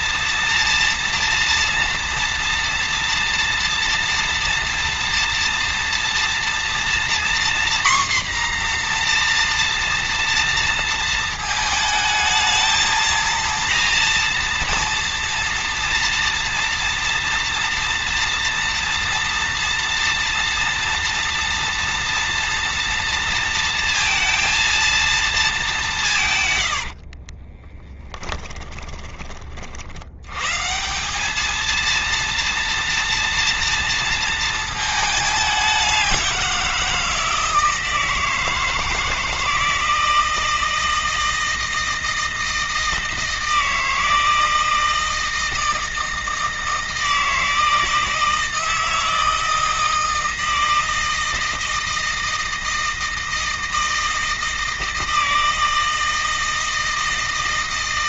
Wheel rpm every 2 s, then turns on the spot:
230, 230, 230, 240, 240, 230, 220, 240, 230, 230, 230, 230, 230, 80, 20, 150, 230, 220, 170, 160, 160, 160, 160, 160, 160, 160, 160, 160, 160.
26-30